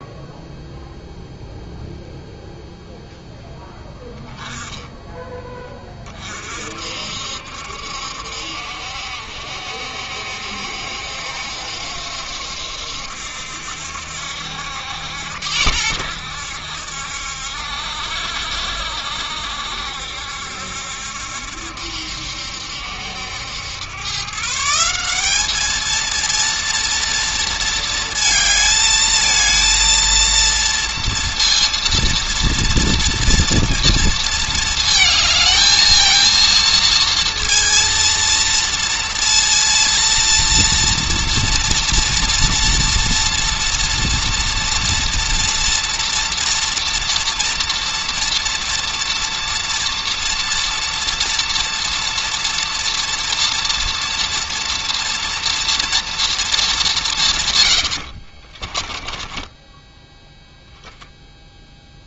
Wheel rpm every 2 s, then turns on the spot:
0, 0, 10, 50, 70, 70, 70, 80, 70, 70, 70, 70, 170, 230, 220, 230, 230, 220, 230, 230, 230, 230, 230, 230, 230, 230, 230, 230, 210, 30, 0.
58-60